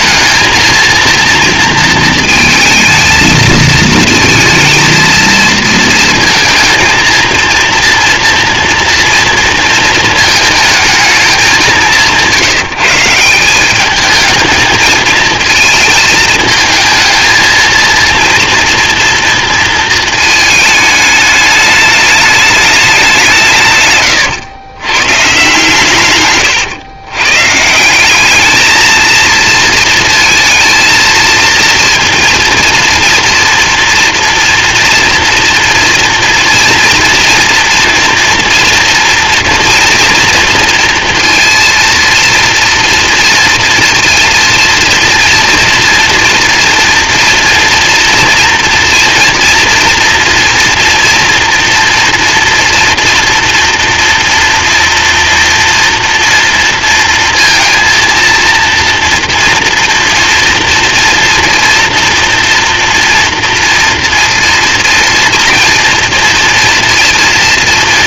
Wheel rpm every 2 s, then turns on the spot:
230, 230, 230, 230, 240, 220, 150, 220, 220, 230, 210, 200, 120, 110, 220, 230, 230, 230, 230, 230, 230, 230, 230, 230, 230, 230, 230, 230, 230, 230, 230, 240, 230, 230.
none